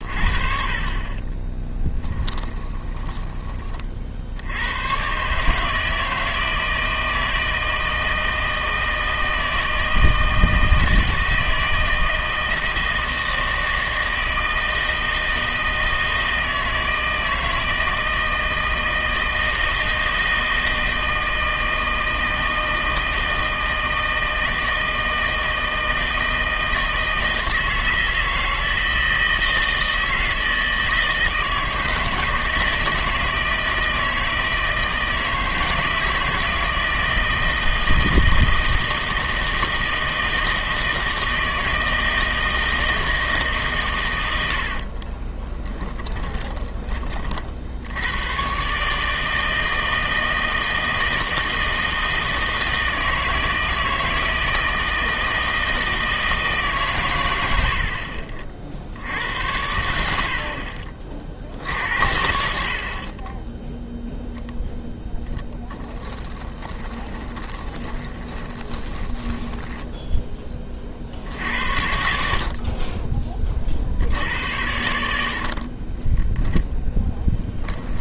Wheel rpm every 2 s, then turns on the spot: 30, 20, 100, 160, 160, 160, 160, 160, 160, 160, 160, 160, 160, 160, 160, 160, 160, 160, 170, 160, 160, 160, 60, 20, 140, 160, 160, 160, 140, 50, 60, 60, 0, 10, 20, 20, 40, 90, 0.
2-4 60-62 66-70